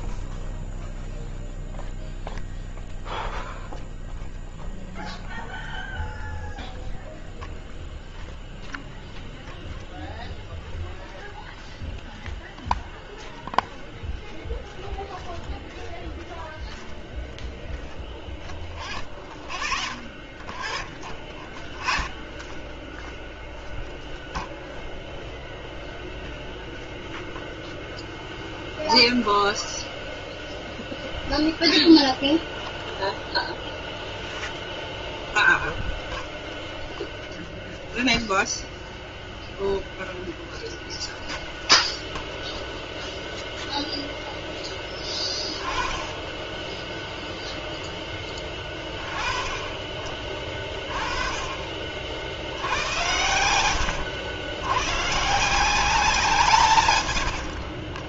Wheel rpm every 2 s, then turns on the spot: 0, 0, 0, 0, 0, 0, 0, 0, 0, 0, 0, 0, 0, 0, 0, 0, 0, 0, 0, 0, 0, 0, 10, 10, 20, 20, 90, 110, 130.
56-58